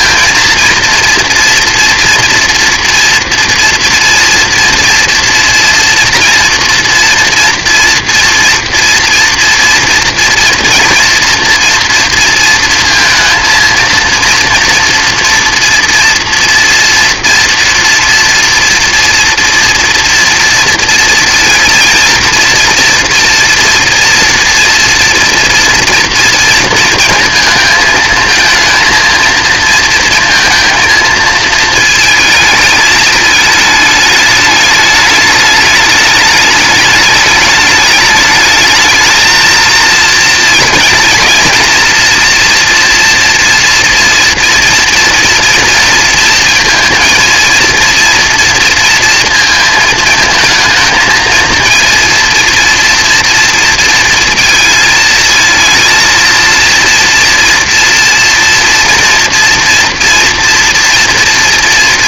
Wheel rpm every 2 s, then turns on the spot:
230, 240, 240, 240, 230, 230, 230, 240, 230, 230, 230, 230, 230, 230, 230, 220, 220, 210, 210, 220, 220, 240, 230, 230, 230, 220, 230, 230, 230, 240, 230.
none